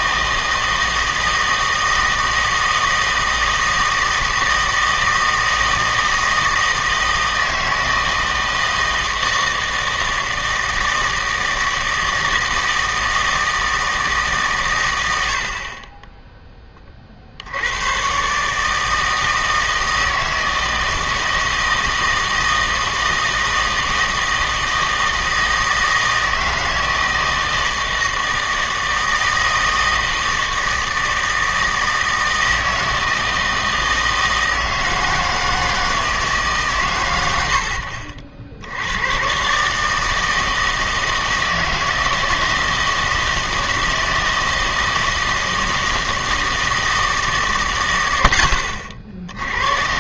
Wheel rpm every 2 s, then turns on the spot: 160, 160, 160, 160, 160, 160, 160, 120, 20, 150, 160, 160, 160, 160, 160, 160, 160, 160, 130, 90, 160, 160, 160, 160, 70.
none